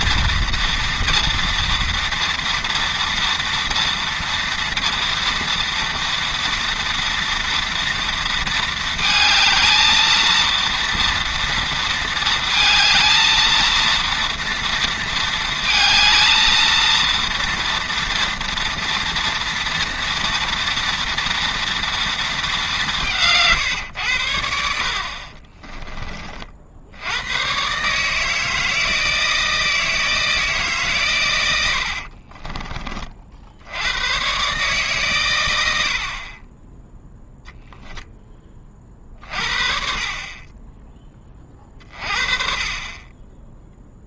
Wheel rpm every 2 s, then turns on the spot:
230, 230, 230, 230, 230, 230, 220, 230, 230, 230, 230, 200, 70, 60, 160, 150, 30, 140, 20, 30, 10, 40.
none